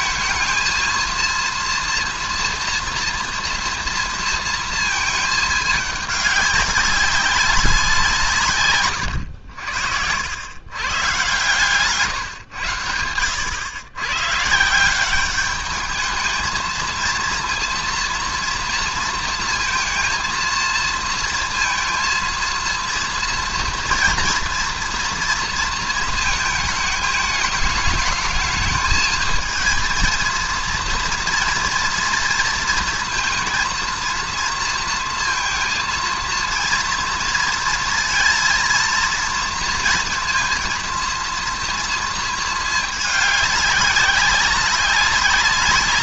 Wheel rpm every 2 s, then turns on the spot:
230, 230, 230, 200, 130, 120, 110, 160, 220, 230, 230, 230, 230, 220, 220, 230, 230, 230, 230, 230, 230, 220, 200.
none